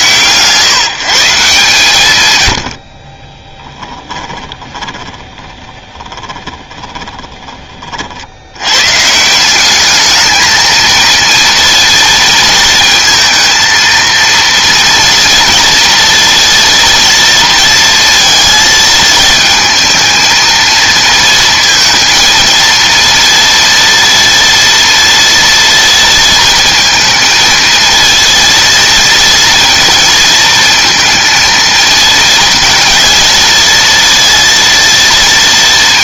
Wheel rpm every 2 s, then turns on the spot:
150, 90, 20, 20, 100, 220, 230, 230, 230, 230, 230, 230, 230, 230, 230, 230, 230, 230.
4-8